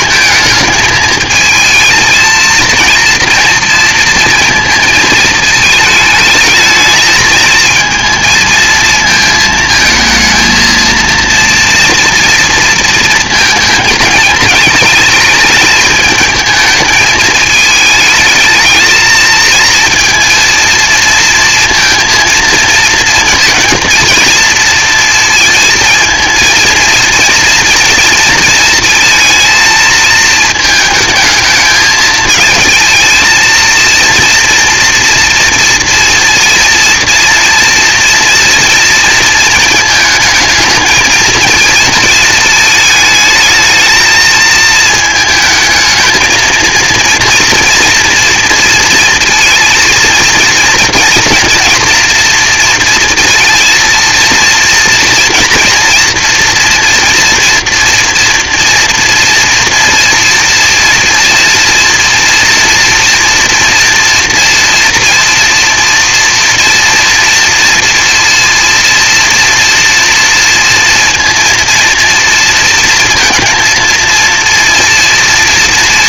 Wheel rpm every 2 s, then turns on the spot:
220, 230, 220, 220, 220, 230, 230, 220, 220, 220, 220, 230, 230, 230, 230, 220, 220, 230, 230, 230, 220, 220, 220, 230, 230, 230, 230, 240, 230, 240, 230, 230, 230, 230, 230, 230, 230, 230.
none